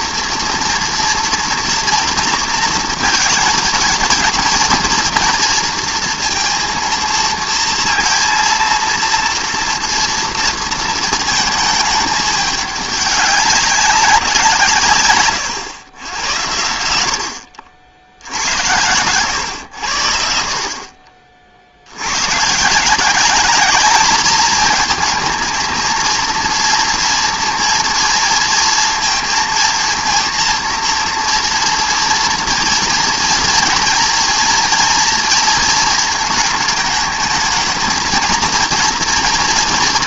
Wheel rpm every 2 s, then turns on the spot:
230, 220, 230, 230, 230, 220, 200, 150, 80, 90, 50, 170, 220, 230, 230, 230, 230, 230, 220, 230.
none